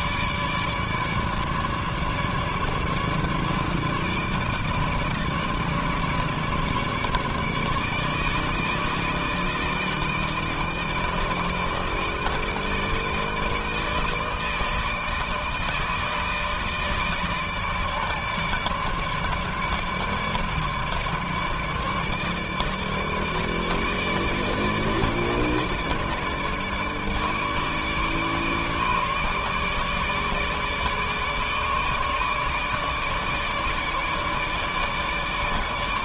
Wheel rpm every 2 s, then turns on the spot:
150, 150, 150, 150, 150, 160, 160, 160, 160, 150, 150, 150, 150, 150, 150, 160, 150, 150.
none